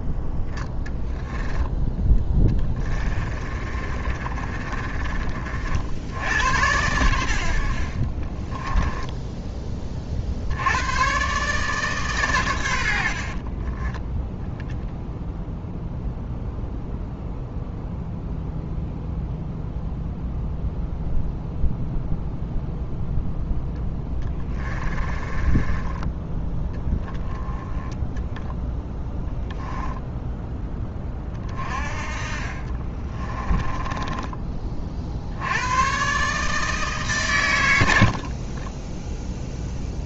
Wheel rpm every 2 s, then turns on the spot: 0, 10, 30, 90, 20, 90, 100, 0, 0, 0, 0, 0, 20, 10, 0, 10, 40, 30, 150, 30.
2-6 8-10 24-26 32-34 38-40